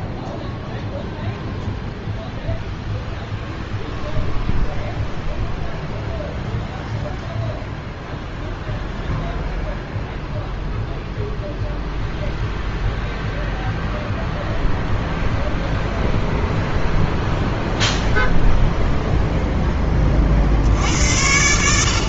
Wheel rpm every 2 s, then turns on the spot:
0, 0, 0, 0, 0, 0, 0, 0, 0, 0, 70.
none